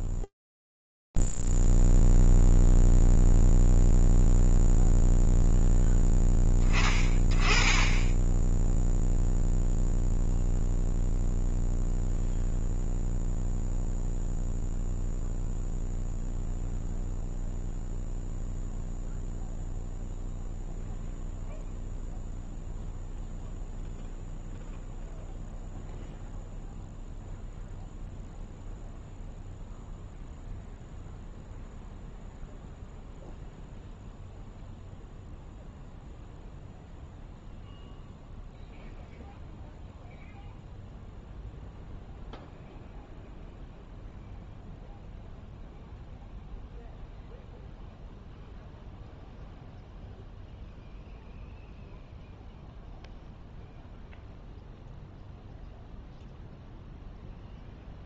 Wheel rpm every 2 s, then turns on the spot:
0, 0, 0, 10, 10, 0, 0, 0, 0, 0, 0, 0, 0, 0, 0, 0, 0, 0, 0, 0, 0, 0, 0, 0, 0, 0, 0, 0, 0.
none